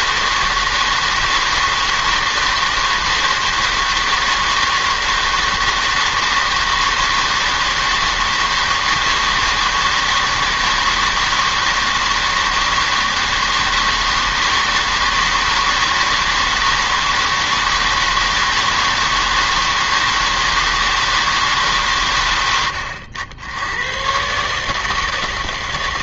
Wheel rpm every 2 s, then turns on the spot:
160, 160, 160, 160, 160, 160, 160, 160, 160, 160, 160, 90, 150.
none